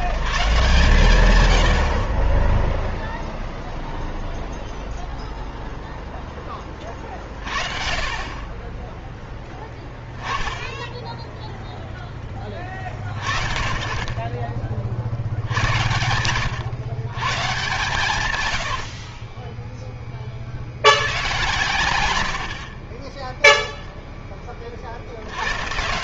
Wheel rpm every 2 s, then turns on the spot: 140, 20, 0, 20, 20, 10, 20, 30, 120, 110, 60, 60, 30.
18-20